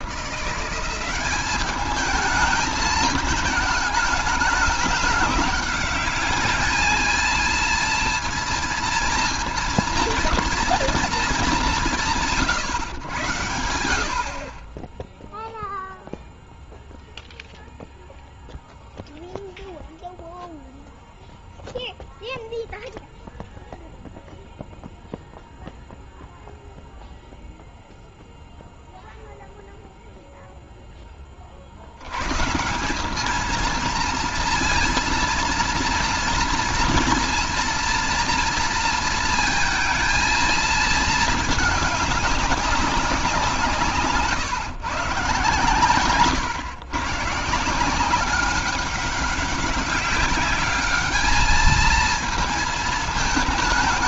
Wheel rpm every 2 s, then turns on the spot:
190, 220, 210, 220, 230, 230, 130, 20, 0, 0, 0, 0, 0, 0, 0, 10, 190, 230, 230, 230, 220, 190, 130, 120, 190, 200, 210.
none